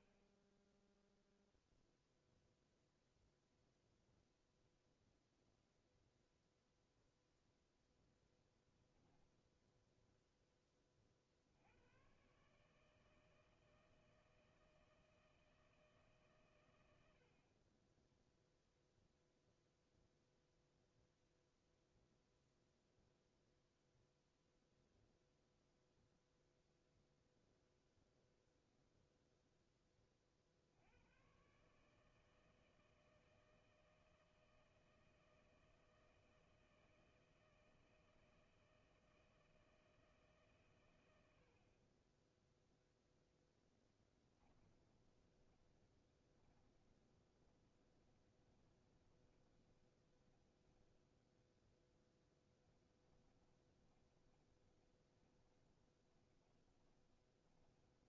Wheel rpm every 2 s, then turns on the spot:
0, 0, 0, 0, 0, 80, 160, 160, 30, 0, 0, 0, 0, 0, 10, 140, 160, 160, 160, 160, 90, 0, 20, 30, 20, 10, 20, 20, 20.
44-50 52-58